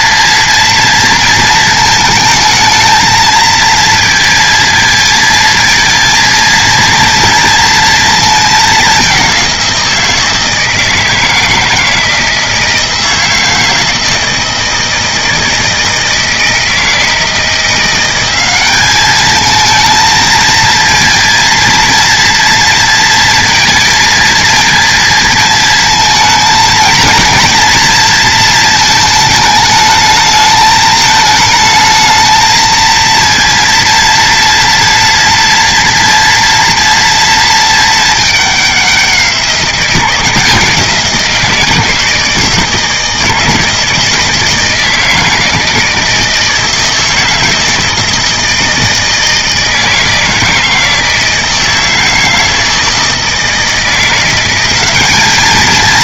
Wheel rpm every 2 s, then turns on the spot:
230, 220, 230, 230, 200, 160, 160, 160, 160, 210, 230, 230, 230, 220, 220, 210, 230, 240, 230, 190, 170, 160, 160, 160, 160, 160, 160, 200.
none